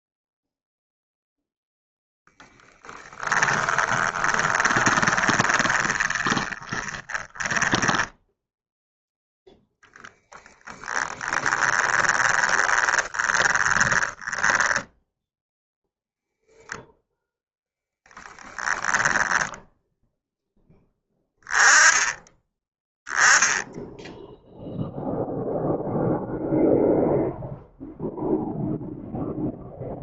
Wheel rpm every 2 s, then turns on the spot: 0, 10, 30, 10, 0, 10, 20, 10, 0, 10, 10, 10, 0, 0, 0.
2-8 12-14